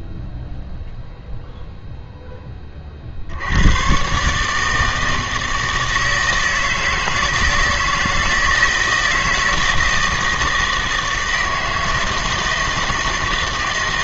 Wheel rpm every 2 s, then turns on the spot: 0, 20, 150, 160, 160, 160, 160.
none